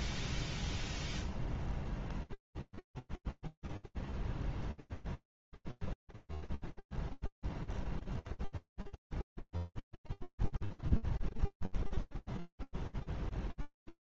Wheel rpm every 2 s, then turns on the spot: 0, 0, 0, 0, 0, 0, 0.
none